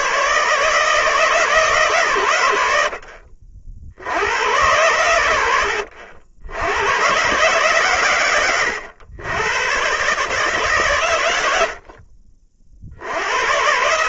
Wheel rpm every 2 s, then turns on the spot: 140, 90, 100, 90, 120, 140, 50.
none